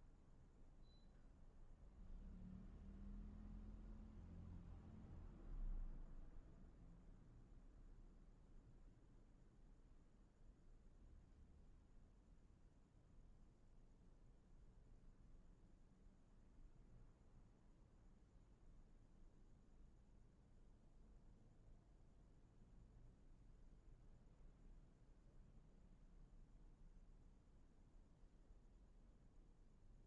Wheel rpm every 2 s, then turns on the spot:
0, 0, 0, 0, 0, 0, 0, 0, 0, 0, 0, 0, 0, 0, 0.
none